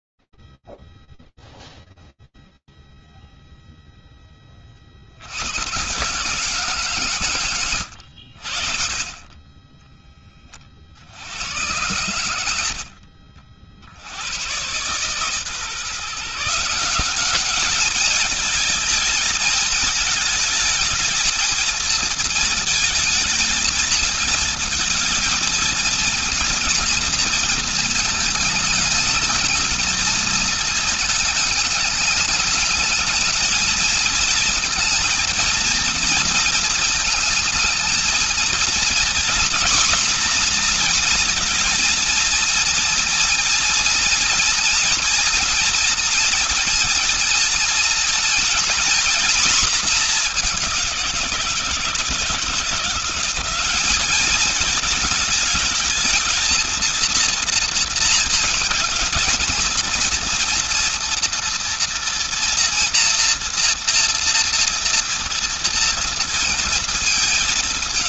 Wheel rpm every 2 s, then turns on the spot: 30, 0, 10, 140, 80, 30, 100, 120, 180, 220, 220, 230, 230, 230, 220, 220, 210, 230, 230, 230, 240, 230, 230, 230, 230, 190, 170, 210, 220, 230, 230, 230, 230, 230.
none